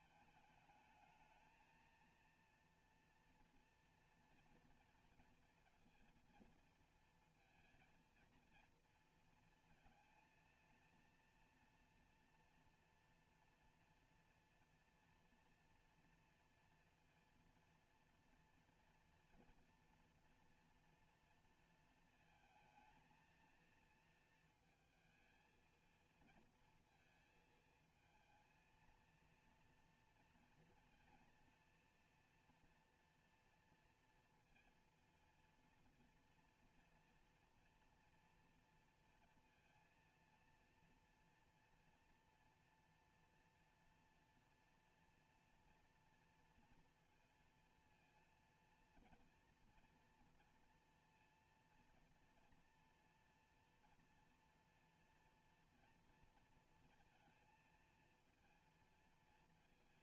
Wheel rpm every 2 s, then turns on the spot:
210, 230, 230, 230, 230, 230, 230, 240, 240, 230, 230, 230, 230, 230, 230, 230, 230, 230, 240, 230, 230, 240, 230, 230, 240, 230, 230, 240, 230, 230.
none